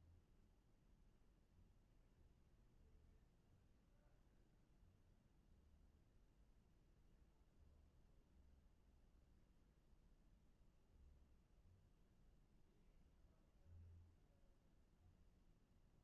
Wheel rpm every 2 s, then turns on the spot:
0, 0, 0, 0, 0, 0, 0, 0.
none